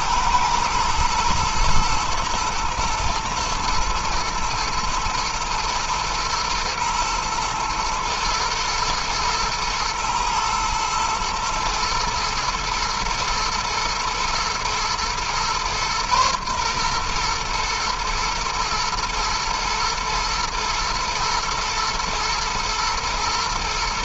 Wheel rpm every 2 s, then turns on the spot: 110, 120, 110, 110, 120, 110, 110, 120, 120, 120, 110, 110.
none